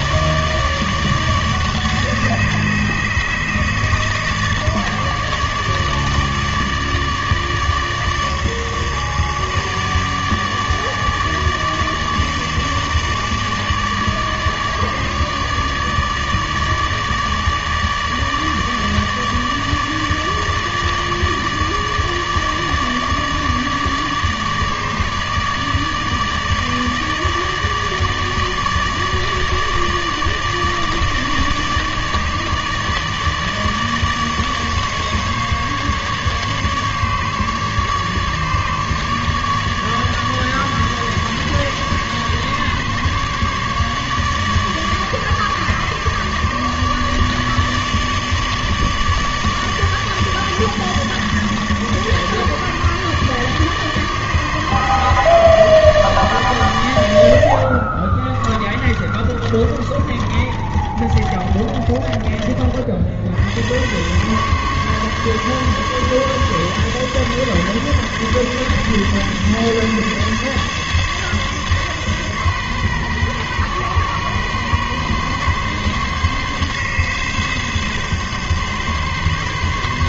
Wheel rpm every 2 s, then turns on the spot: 150, 150, 150, 150, 150, 150, 150, 150, 150, 150, 150, 150, 150, 150, 150, 150, 150, 150, 150, 150, 150, 140, 150, 150, 150, 150, 150, 150, 130, 30, 30, 40, 140, 140, 140, 140, 130, 130, 140, 140.
58-62